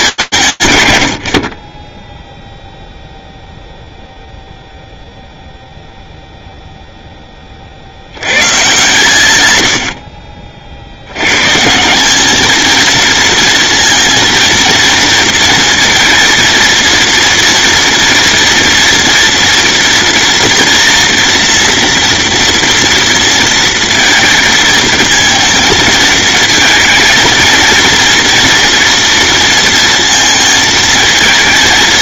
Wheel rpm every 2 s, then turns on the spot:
100, 0, 0, 20, 120, 120, 230, 230, 230, 230, 230, 230, 220, 230, 230, 220.
none